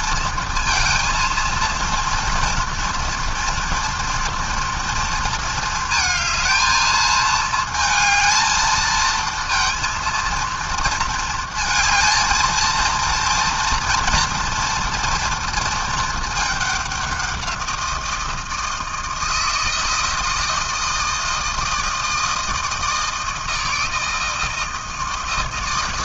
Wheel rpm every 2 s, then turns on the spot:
230, 230, 230, 220, 230, 230, 230, 230, 190, 160, 160, 160, 160.
none